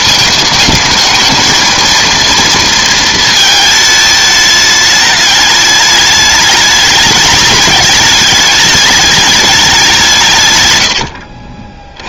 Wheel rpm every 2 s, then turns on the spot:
220, 230, 210, 210, 210, 110.
none